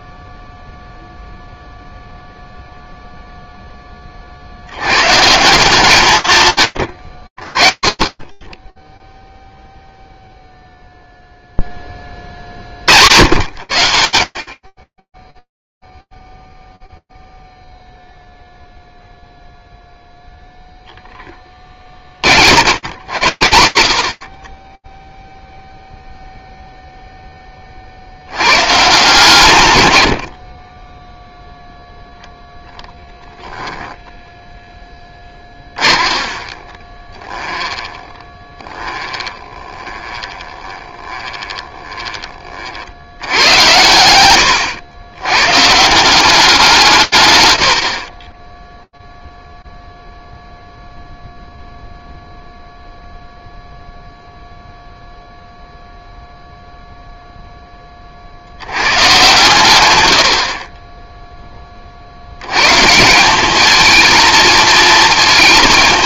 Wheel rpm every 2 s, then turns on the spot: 0, 0, 70, 120, 20, 0, 90, 10, 0, 0, 0, 70, 20, 0, 140, 0, 0, 20, 20, 20, 30, 100, 160, 60, 0, 0, 0, 0, 10, 110, 10, 210, 220.
34-42